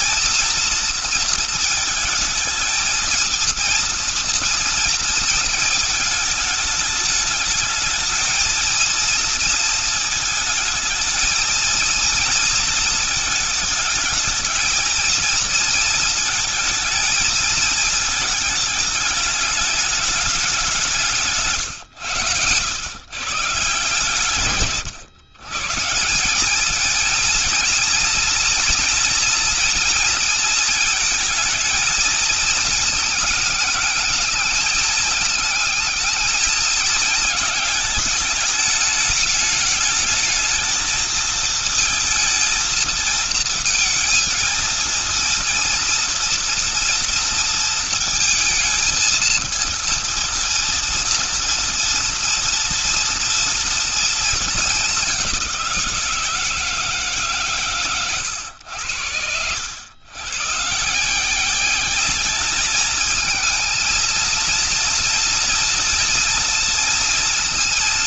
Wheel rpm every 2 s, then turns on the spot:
230, 220, 230, 210, 230, 220, 220, 220, 220, 210, 170, 140, 130, 230, 240, 220, 220, 210, 210, 220, 220, 230, 230, 230, 230, 230, 230, 200, 160, 90, 160, 220, 230, 230.
none